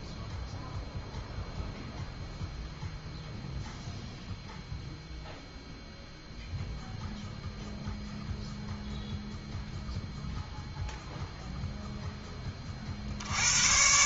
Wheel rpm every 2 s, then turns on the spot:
0, 0, 0, 0, 0, 0, 50.
none